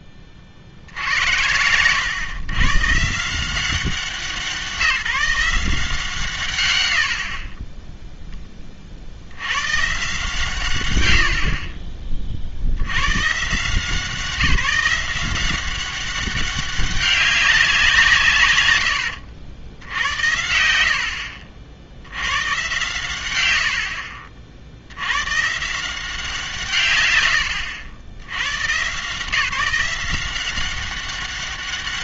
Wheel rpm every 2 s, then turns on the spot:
40, 130, 170, 130, 20, 130, 60, 170, 190, 120, 70, 120, 70, 140, 130, 190.
none